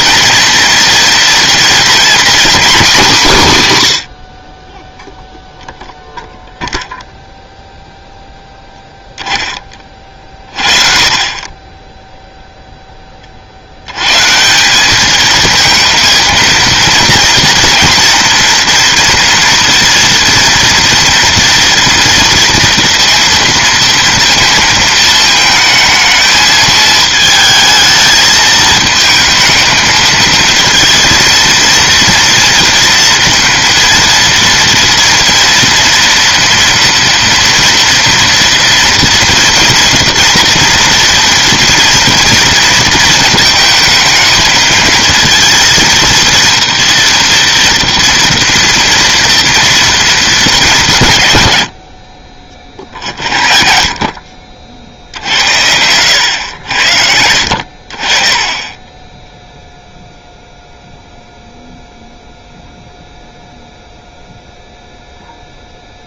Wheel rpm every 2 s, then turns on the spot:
230, 210, 0, 0, 10, 40, 0, 190, 230, 240, 230, 230, 220, 220, 220, 230, 230, 230, 240, 230, 230, 230, 220, 230, 240, 180, 40, 60, 80, 20, 0, 0, 0.
58-60